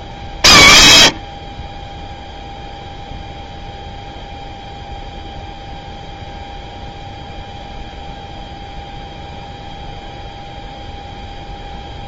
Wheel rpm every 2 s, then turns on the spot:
90, 0, 0, 0, 0, 0.
none